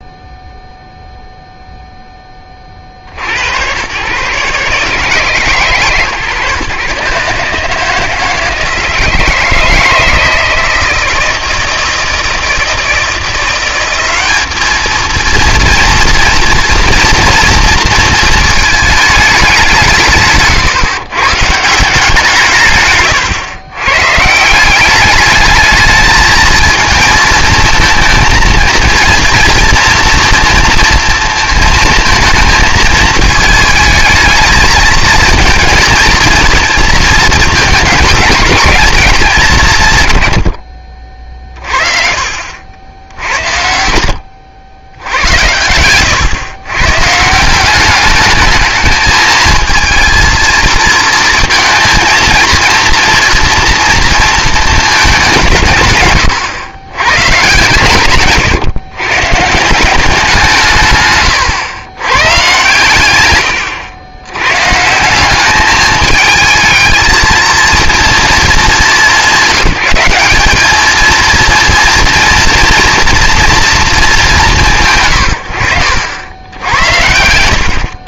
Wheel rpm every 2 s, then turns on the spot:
0, 40, 150, 140, 160, 160, 160, 210, 230, 220, 140, 140, 180, 220, 230, 230, 220, 220, 230, 200, 60, 70, 80, 120, 220, 230, 230, 220, 110, 140, 150, 120, 140, 220, 200, 210, 230, 160, 90.
none